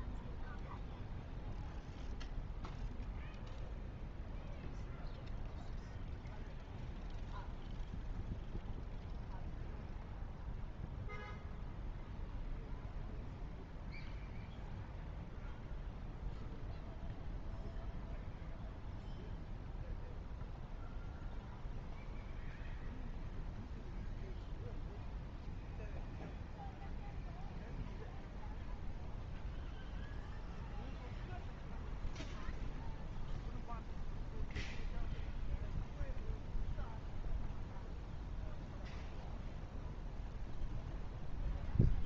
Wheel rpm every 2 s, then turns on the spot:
0, 0, 0, 0, 0, 0, 0, 0, 0, 0, 0, 0, 0, 0, 0, 0, 0, 0, 0, 0, 0.
none